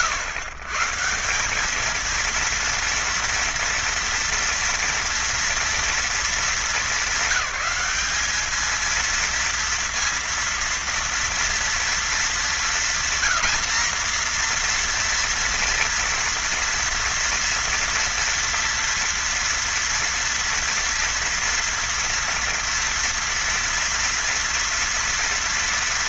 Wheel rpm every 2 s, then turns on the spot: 130, 230, 230, 220, 230, 230, 200, 240, 230, 240, 240, 230, 230.
none